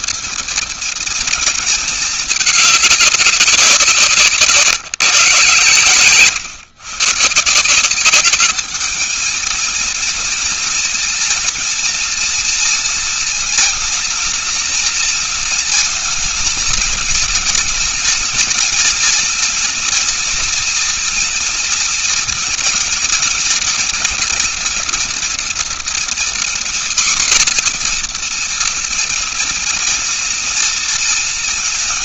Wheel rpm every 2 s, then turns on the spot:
220, 210, 170, 120, 200, 230, 230, 230, 220, 230, 230, 230, 240, 240, 240, 230.
none